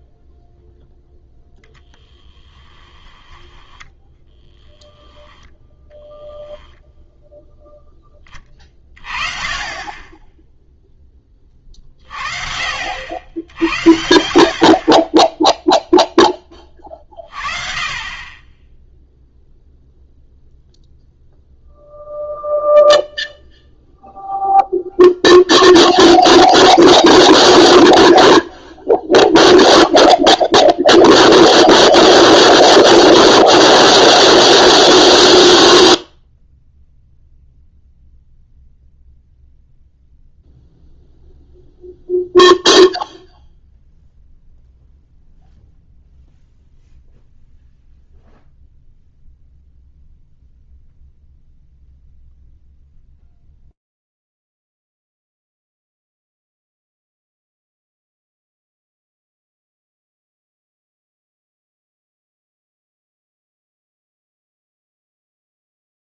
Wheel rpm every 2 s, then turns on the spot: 0, 10, 20, 0, 20, 10, 50, 60, 20, 20, 0, 0, 0, 0, 0, 0, 0, 0, 0, 0, 0, 0, 0, 0, 0, 0, 0, 0, 0, 0, 0, 10, 20.
2-6